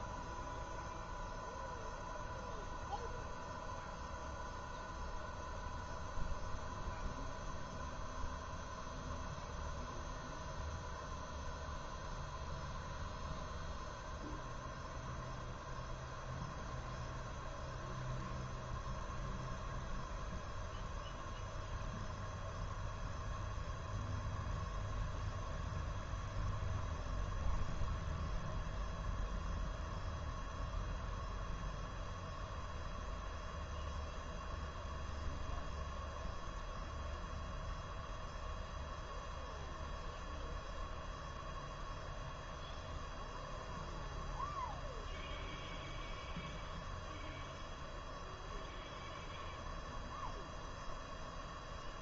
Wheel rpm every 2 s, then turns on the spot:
0, 0, 0, 0, 0, 0, 0, 0, 0, 0, 0, 0, 0, 0, 0, 0, 0, 0, 0, 0, 0, 0, 0, 0, 0, 0.
none